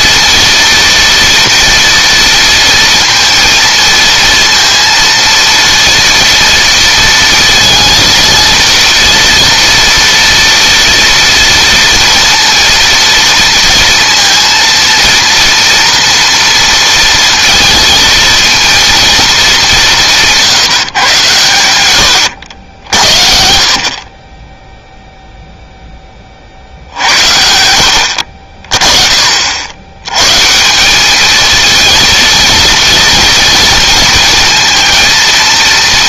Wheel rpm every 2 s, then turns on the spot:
230, 230, 230, 230, 230, 240, 230, 230, 230, 220, 130, 60, 0, 60, 50, 200, 230, 230.
none